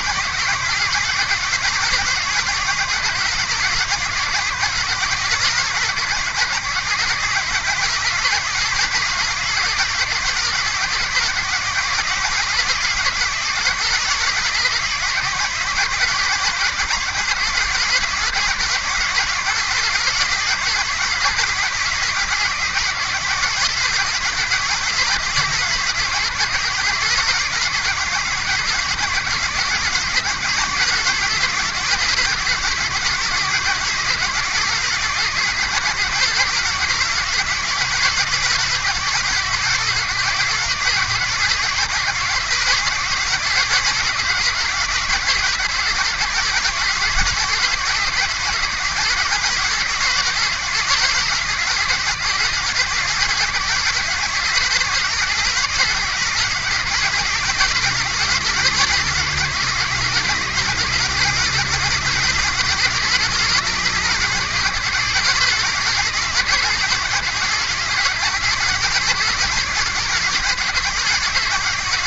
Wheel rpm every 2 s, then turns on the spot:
140, 140, 130, 130, 140, 130, 140, 140, 130, 140, 140, 140, 140, 140, 130, 140, 140, 140, 140, 140, 140, 140, 140, 130, 130, 140, 130, 140, 140, 140, 140, 140, 130, 130, 140, 140.
none